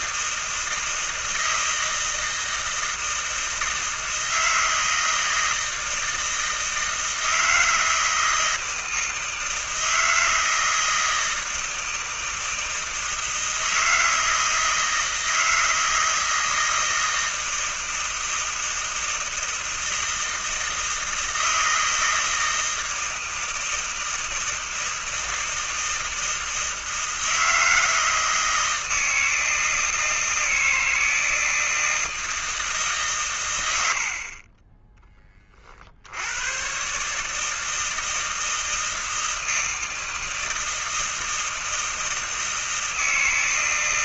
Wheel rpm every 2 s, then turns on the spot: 160, 160, 160, 160, 160, 160, 160, 160, 160, 160, 160, 160, 160, 160, 160, 160, 160, 30, 110, 160, 160, 160.
none